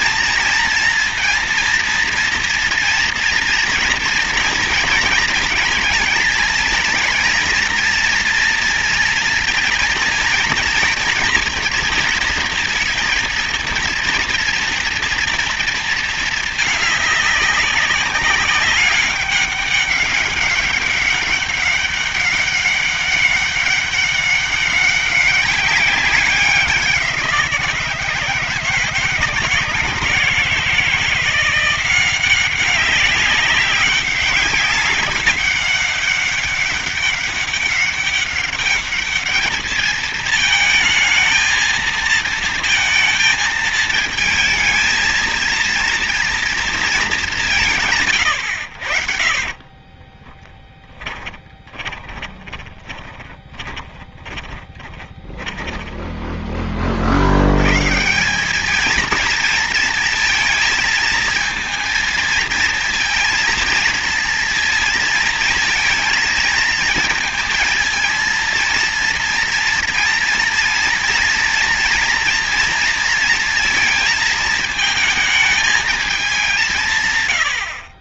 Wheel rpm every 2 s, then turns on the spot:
230, 230, 230, 230, 230, 230, 230, 230, 210, 190, 200, 200, 190, 190, 160, 170, 190, 200, 200, 200, 220, 230, 220, 220, 60, 10, 40, 20, 30, 210, 230, 230, 230, 220, 230, 230, 230, 220, 160.
50-56